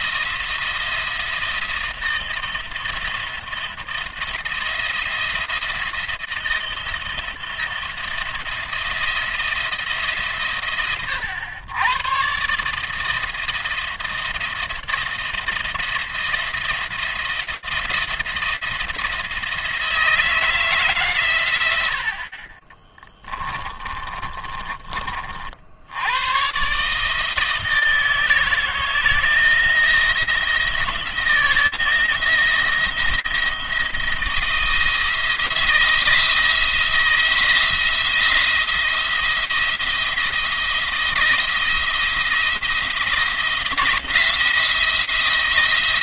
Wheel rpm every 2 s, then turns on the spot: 170, 160, 170, 170, 170, 110, 150, 160, 170, 160, 140, 30, 30, 140, 160, 170, 170, 160, 160, 170, 170, 170, 170.
22-24